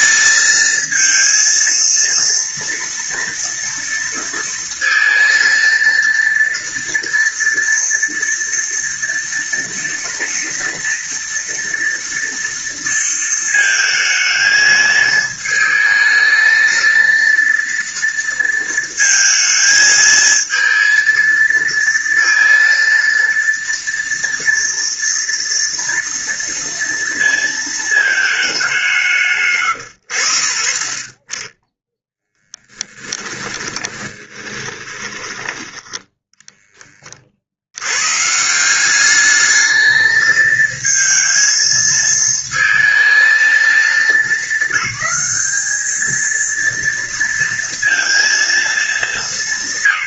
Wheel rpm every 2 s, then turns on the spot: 230, 230, 230, 230, 230, 230, 230, 220, 230, 230, 230, 230, 230, 230, 190, 30, 10, 20, 30, 190, 230, 230, 210, 230, 220.
32-36